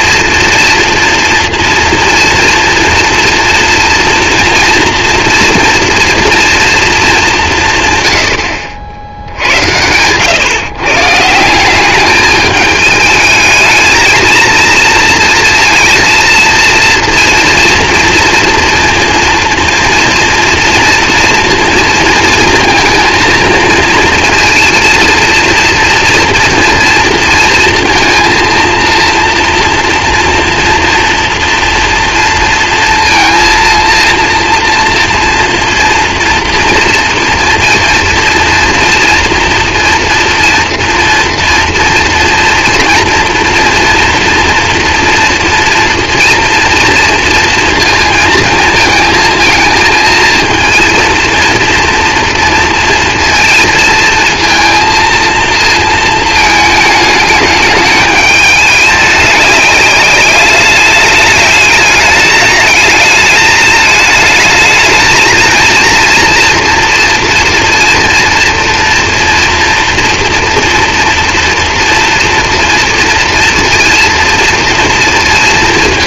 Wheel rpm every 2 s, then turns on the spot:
230, 240, 230, 240, 80, 130, 210, 220, 230, 230, 240, 220, 230, 230, 230, 240, 230, 230, 230, 230, 230, 230, 230, 230, 230, 230, 230, 230, 220, 210, 200, 210, 220, 230, 240, 230, 230, 230.
none